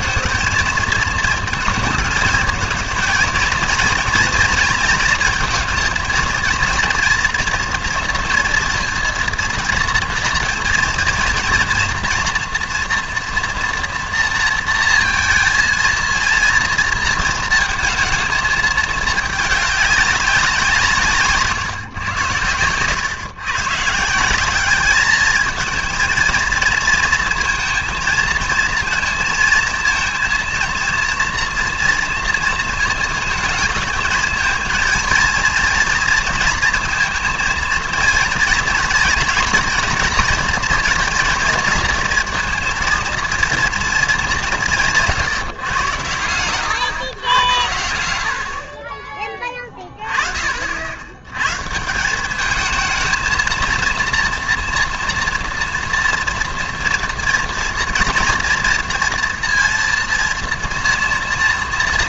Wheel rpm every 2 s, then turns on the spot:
230, 230, 230, 230, 230, 230, 230, 230, 230, 220, 180, 100, 200, 230, 230, 230, 230, 220, 230, 230, 230, 230, 170, 120, 40, 60, 220, 230, 230, 240, 230.
22-24